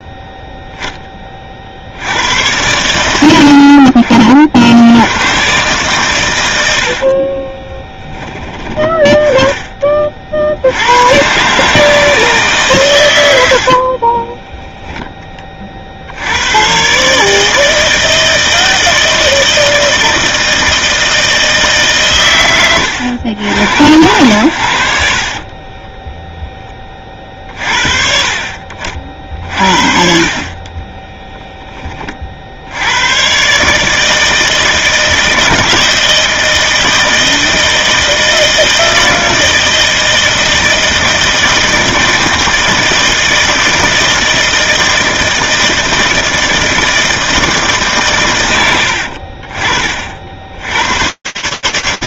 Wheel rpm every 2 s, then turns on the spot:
0, 100, 70, 80, 20, 80, 140, 10, 120, 160, 160, 110, 80, 10, 50, 40, 70, 160, 160, 160, 160, 160, 160, 160, 110, 80.
14-16